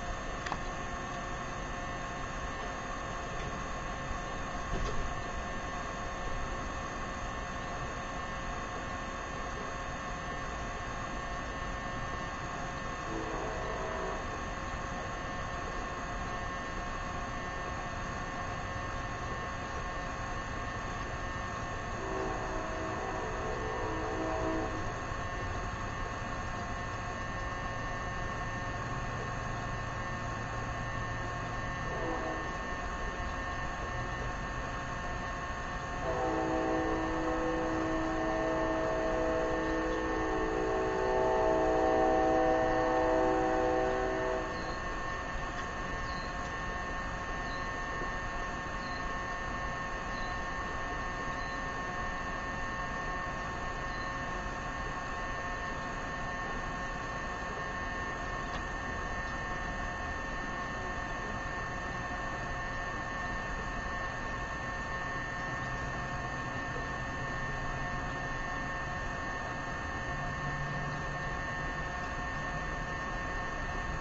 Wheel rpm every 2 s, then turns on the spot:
0, 0, 0, 0, 0, 0, 0, 0, 0, 0, 0, 0, 0, 0, 0, 0, 0, 0, 0, 0, 0, 0, 0, 0, 0, 0, 0, 0, 0, 0, 0, 0, 0, 0, 0, 0, 0.
none